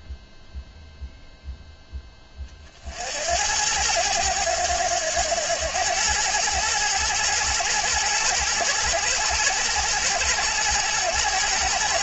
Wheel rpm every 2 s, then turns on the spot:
0, 50, 100, 110, 110, 110.
none